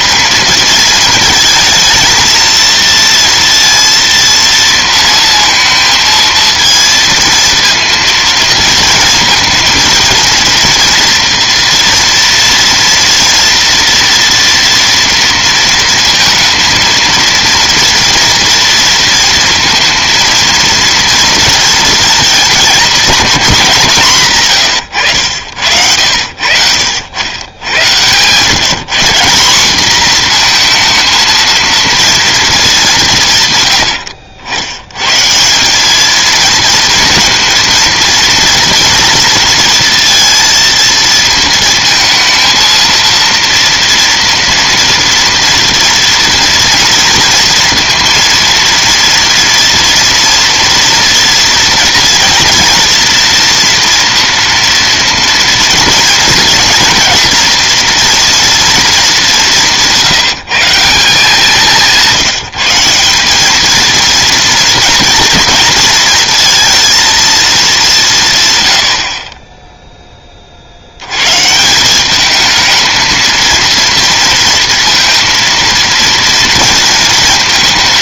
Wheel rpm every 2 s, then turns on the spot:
220, 230, 230, 230, 230, 230, 240, 230, 230, 230, 230, 220, 100, 80, 160, 230, 210, 100, 230, 230, 230, 230, 230, 230, 230, 240, 240, 230, 230, 220, 170, 170, 240, 230, 90, 60, 220, 230, 230.
none